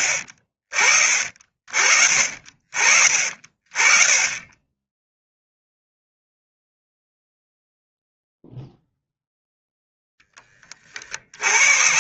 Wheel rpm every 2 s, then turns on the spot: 40, 40, 20, 0, 0, 10.
none